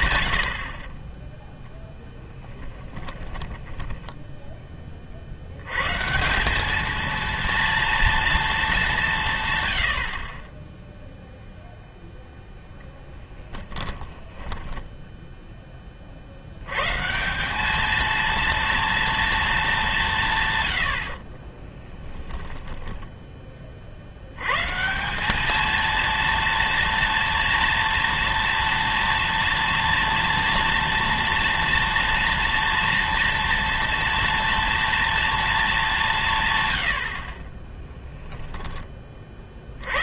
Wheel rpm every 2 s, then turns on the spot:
60, 30, 20, 200, 220, 10, 0, 10, 100, 230, 120, 10, 130, 230, 230, 230, 230, 230, 130, 10.
2-4 14-16 22-24